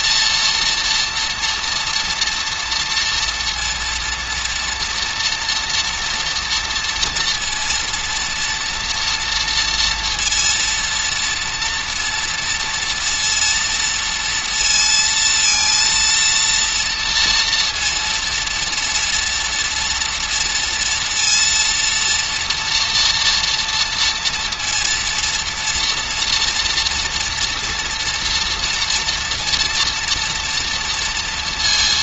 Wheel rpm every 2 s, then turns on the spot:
230, 240, 230, 230, 230, 230, 230, 230, 230, 230, 230, 230, 230, 230, 230, 230.
none